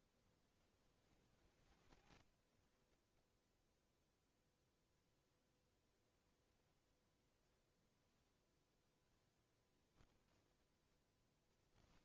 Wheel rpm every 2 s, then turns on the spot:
10, 20, 0, 0, 0, 0.
2-4